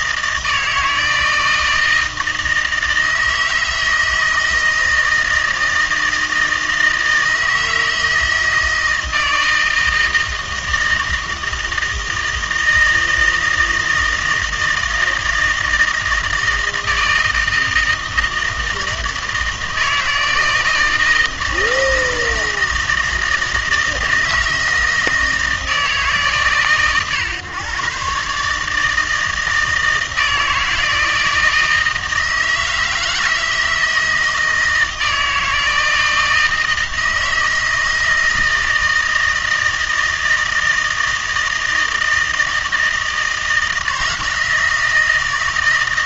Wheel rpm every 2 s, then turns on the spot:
160, 160, 160, 160, 160, 160, 160, 160, 160, 160, 160, 160, 160, 130, 150, 160, 160, 170, 160, 160, 160, 160, 170.
none